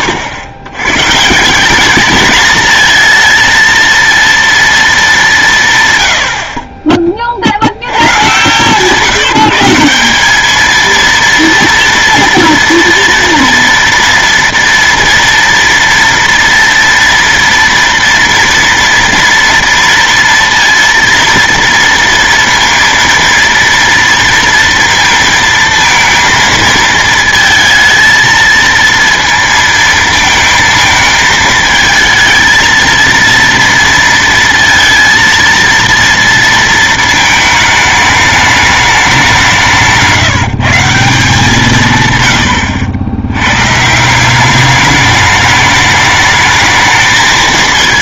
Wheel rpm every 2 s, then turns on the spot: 120, 220, 230, 30, 150, 220, 230, 230, 230, 230, 230, 230, 230, 230, 230, 220, 230, 230, 220, 210, 170, 90, 200, 220.
none